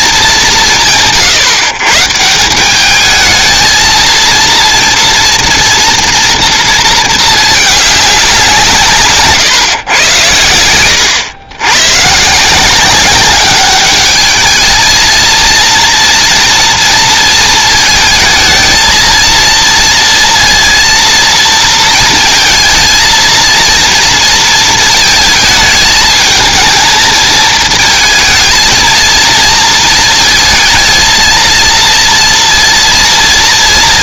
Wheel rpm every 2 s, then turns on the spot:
140, 230, 230, 210, 110, 120, 210, 230, 220, 230, 230, 230, 220, 220, 230, 230, 230.
none